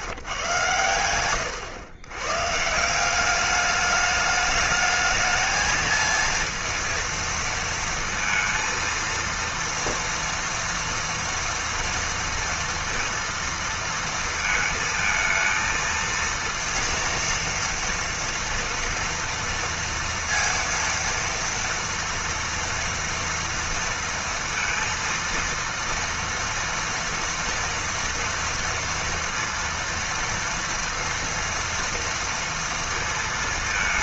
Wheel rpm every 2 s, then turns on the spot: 110, 150, 210, 230, 230, 230, 230, 220, 230, 240, 230, 230, 230, 230, 230, 230, 230.
none